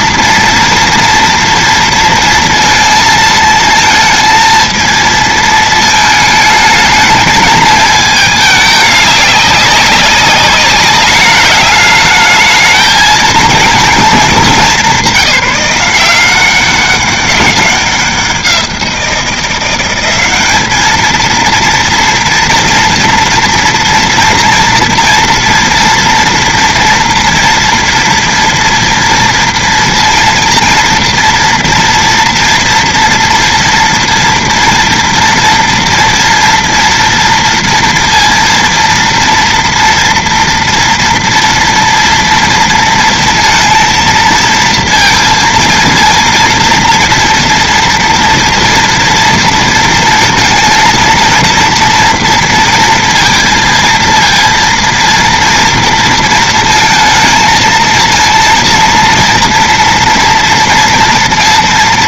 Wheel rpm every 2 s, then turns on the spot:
230, 230, 230, 220, 220, 200, 220, 210, 180, 180, 200, 230, 230, 240, 230, 230, 230, 230, 230, 230, 230, 230, 230, 230, 230, 230, 230, 230, 230, 230, 230.
none